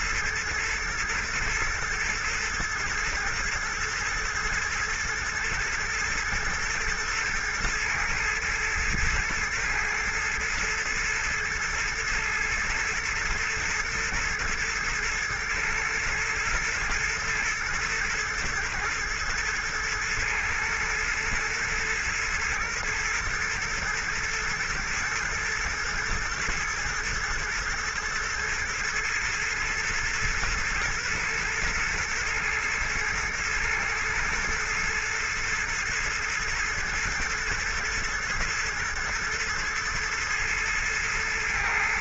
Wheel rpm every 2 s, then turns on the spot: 110, 120, 120, 110, 120, 110, 110, 110, 120, 120, 120, 120, 110, 120, 120, 120, 110, 120, 120, 120, 110.
none